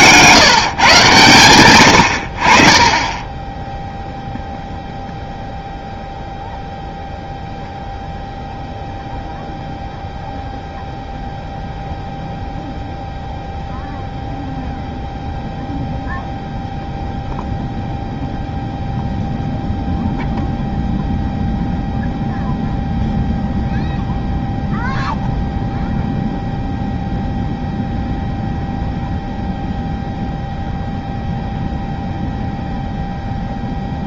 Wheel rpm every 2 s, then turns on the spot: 140, 30, 0, 0, 0, 0, 0, 0, 0, 0, 0, 0, 0, 0, 0, 0, 0.
none